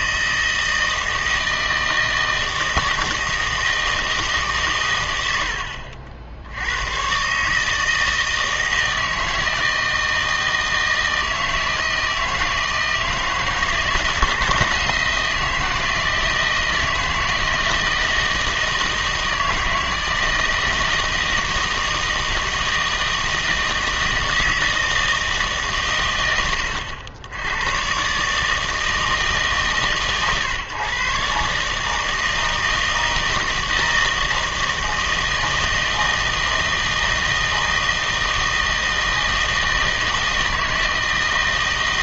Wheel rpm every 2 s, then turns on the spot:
160, 160, 130, 90, 160, 160, 160, 170, 160, 160, 160, 160, 160, 100, 160, 130, 160, 160, 160, 160, 160.
none